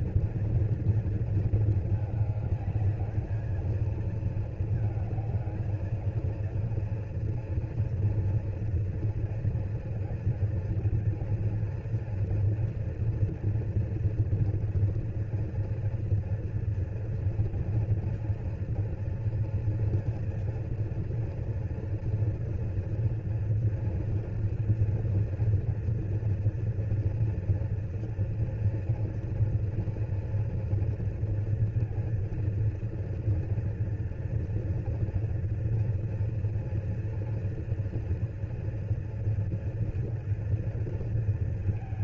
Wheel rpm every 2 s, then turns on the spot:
230, 210, 220, 230, 230, 230, 230, 230, 230, 230, 240, 230, 230, 230, 230, 230, 230, 230, 230, 230, 230.
none